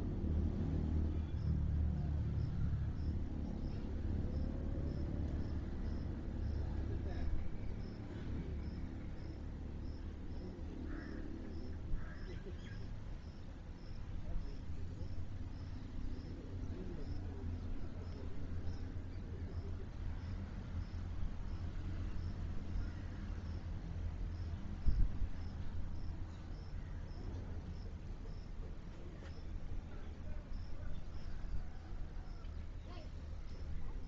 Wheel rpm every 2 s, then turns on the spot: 0, 0, 0, 0, 0, 0, 0, 0, 0, 0, 0, 0, 0, 0, 0, 0, 0.
none